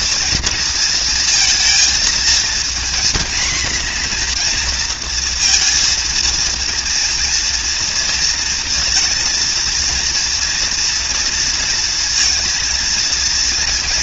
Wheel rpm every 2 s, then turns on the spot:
230, 240, 230, 230, 230, 240, 220.
none